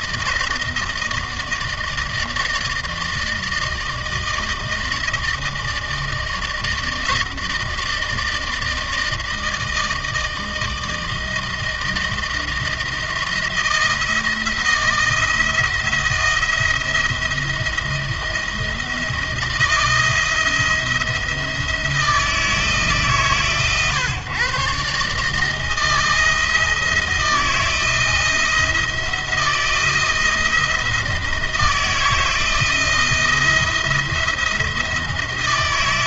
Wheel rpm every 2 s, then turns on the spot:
160, 160, 160, 160, 160, 160, 170, 160, 170, 160, 170, 150, 140, 160, 170, 170, 170, 170.
none